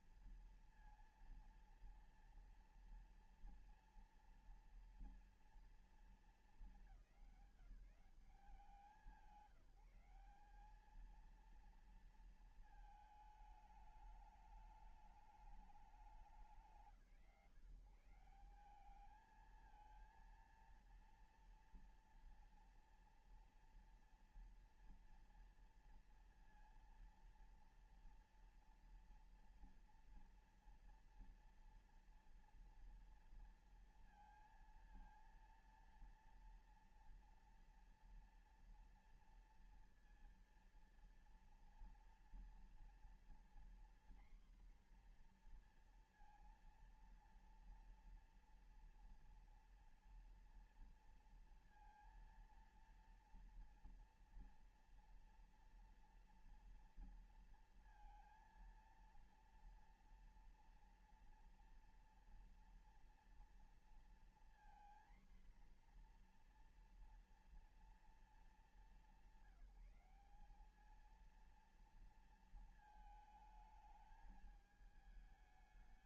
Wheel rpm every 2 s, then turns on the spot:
230, 230, 230, 220, 190, 190, 230, 210, 180, 170, 230, 240, 230, 230, 230, 230, 230, 230, 230, 230, 230, 240, 240, 240, 240, 230, 230, 230, 230, 230, 240, 230, 240, 240, 210, 200, 230, 220.
none